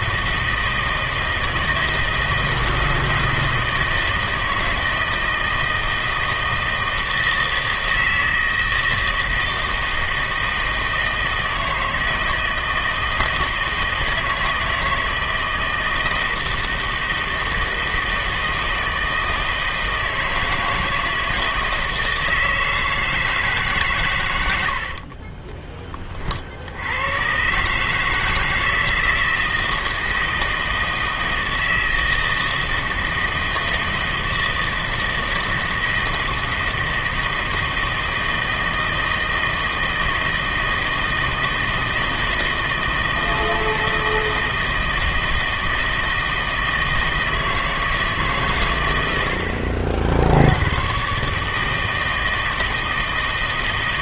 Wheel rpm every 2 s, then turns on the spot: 160, 160, 160, 160, 160, 160, 160, 160, 160, 160, 160, 160, 70, 80, 160, 160, 160, 160, 160, 160, 160, 160, 160, 160, 120, 100, 160.
24-26